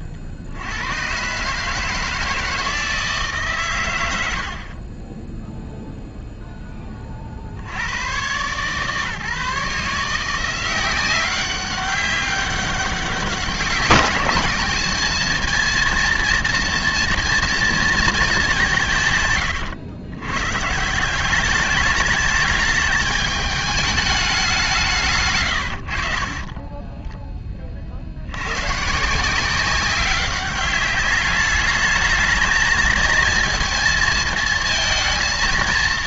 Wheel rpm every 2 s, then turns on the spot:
110, 160, 50, 10, 140, 180, 190, 210, 230, 180, 140, 210, 180, 10, 130, 200, 220, 220.
26-28